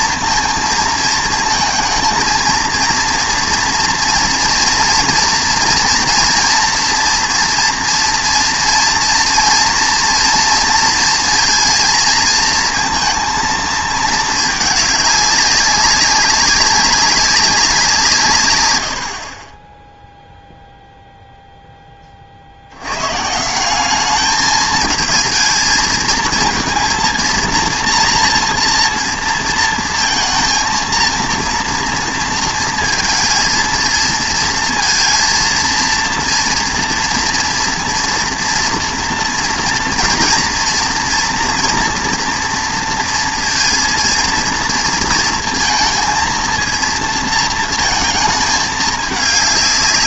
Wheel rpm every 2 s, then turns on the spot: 230, 230, 240, 230, 230, 230, 230, 210, 200, 100, 0, 80, 210, 230, 230, 230, 230, 230, 230, 240, 230, 230, 230, 230, 210.
none